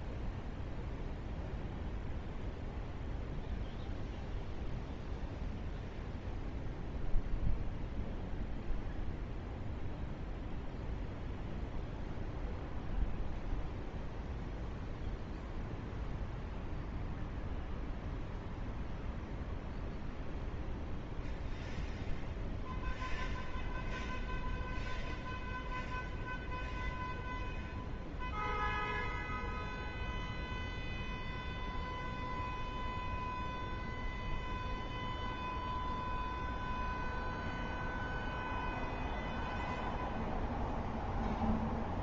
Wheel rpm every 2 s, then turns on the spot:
0, 0, 0, 0, 0, 0, 0, 0, 0, 0, 0, 0, 0, 0, 0, 0, 0, 0, 0, 0, 0.
none